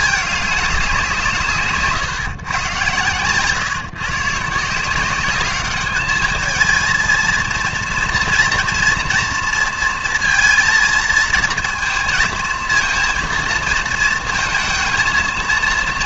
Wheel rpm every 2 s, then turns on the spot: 200, 130, 160, 220, 230, 230, 230, 230.
none